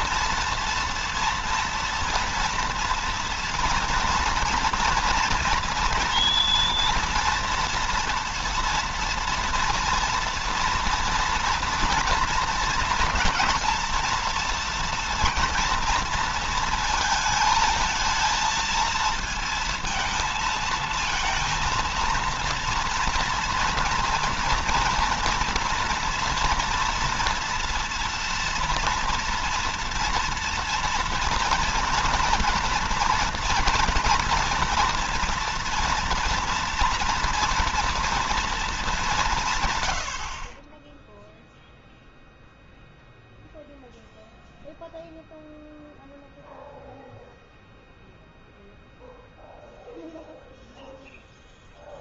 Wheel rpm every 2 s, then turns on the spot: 230, 230, 230, 230, 230, 230, 230, 230, 230, 230, 230, 230, 230, 230, 230, 240, 240, 230, 230, 210, 30, 0, 0, 0, 0, 0.
none